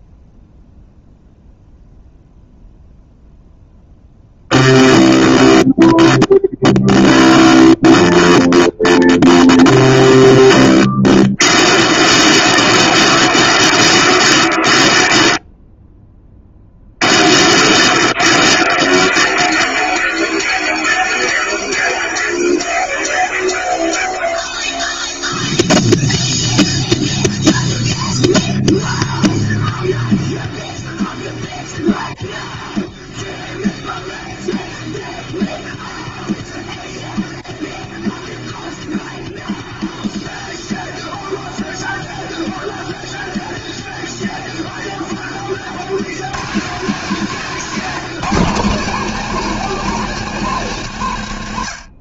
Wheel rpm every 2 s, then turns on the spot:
0, 0, 0, 0, 0, 0, 0, 0, 0, 0, 0, 0, 0, 0, 0, 0, 0, 0, 0, 0, 0, 0, 30, 190, 210, 110.
none